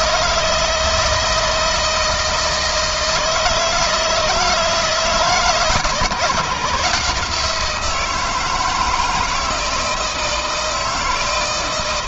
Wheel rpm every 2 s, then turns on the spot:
160, 160, 160, 150, 160, 160.
none